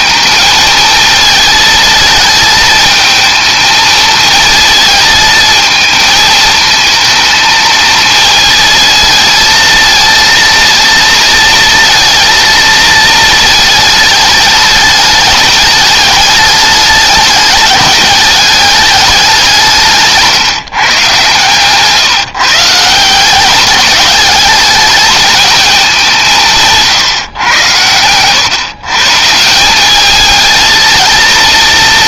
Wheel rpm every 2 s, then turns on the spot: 220, 220, 220, 220, 230, 230, 220, 210, 210, 210, 160, 150, 210, 160, 130, 220.
none